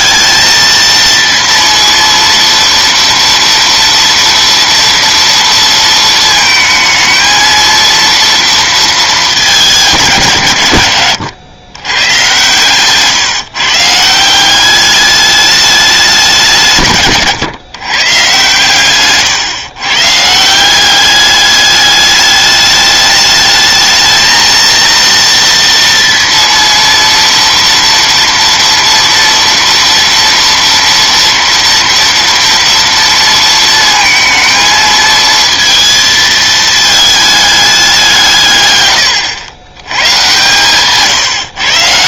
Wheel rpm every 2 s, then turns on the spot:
220, 230, 230, 220, 230, 130, 130, 190, 170, 130, 160, 210, 230, 230, 230, 230, 230, 220, 220, 150, 130.
none